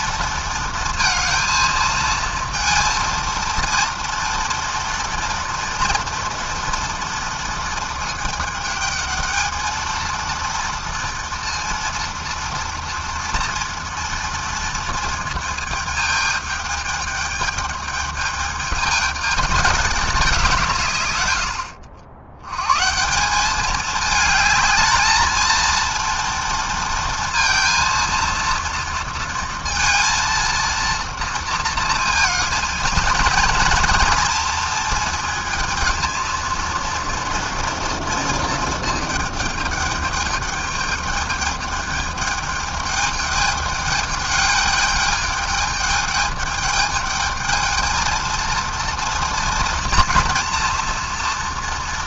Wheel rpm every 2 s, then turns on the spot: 230, 230, 230, 230, 220, 230, 230, 220, 210, 210, 110, 180, 220, 230, 230, 230, 230, 220, 230, 220, 210, 210, 210, 210, 240, 240.
none